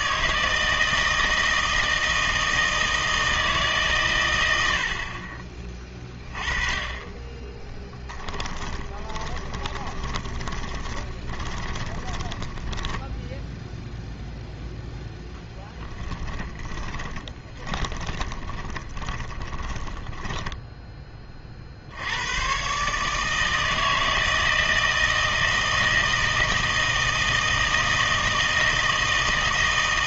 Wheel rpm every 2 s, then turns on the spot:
160, 160, 80, 20, 10, 20, 10, 0, 10, 20, 10, 140, 160, 160, 160.
8-14 16-20